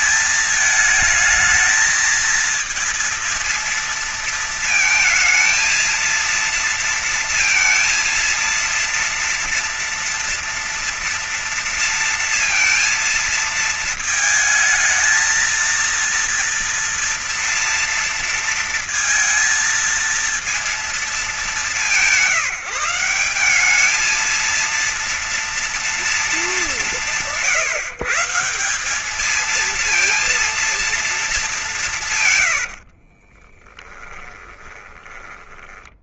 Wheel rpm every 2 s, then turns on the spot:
220, 230, 230, 230, 230, 230, 230, 220, 230, 230, 230, 160, 220, 200, 160, 230, 100, 10.
32-36